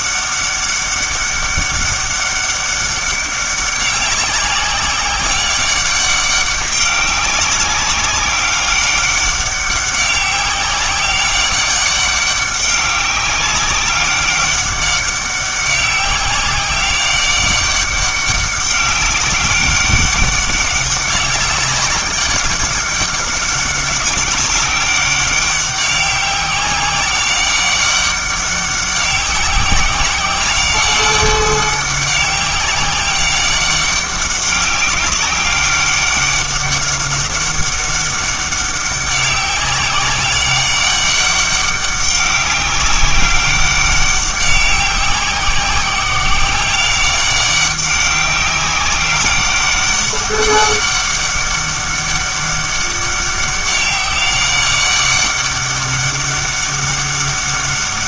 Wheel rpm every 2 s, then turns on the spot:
200, 200, 190, 200, 200, 200, 200, 200, 190, 200, 200, 200, 200, 190, 190, 190, 190, 200, 190, 200, 200, 200, 190, 190, 190, 200, 200, 200, 200.
none